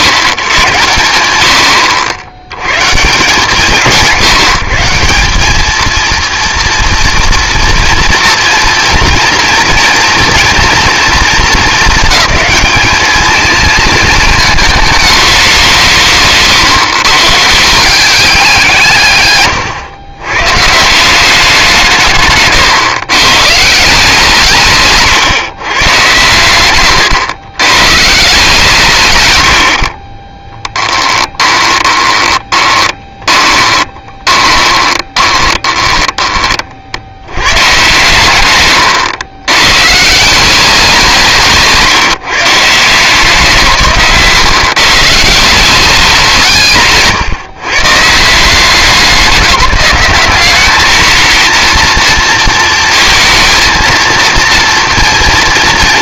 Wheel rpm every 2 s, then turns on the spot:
130, 80, 150, 230, 230, 230, 210, 220, 140, 180, 130, 130, 150, 120, 160, 20, 20, 20, 30, 130, 180, 160, 140, 150, 170, 190, 230, 230.
16-18 32-36